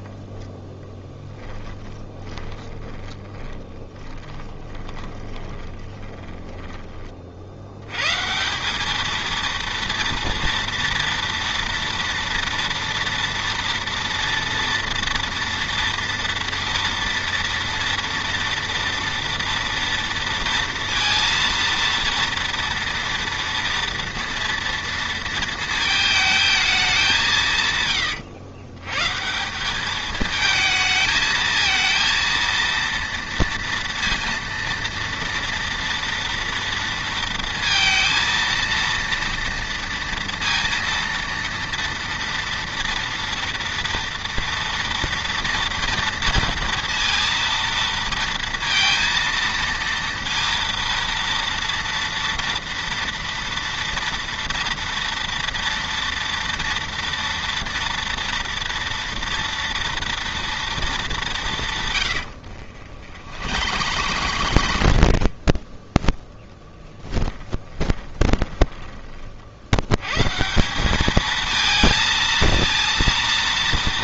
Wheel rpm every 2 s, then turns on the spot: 10, 30, 10, 10, 190, 230, 230, 230, 230, 230, 230, 230, 230, 210, 110, 220, 230, 230, 230, 230, 230, 230, 230, 230, 230, 230, 230, 230, 230, 240, 230, 70, 90, 10, 20, 180, 230.
0-6 62-66 68-70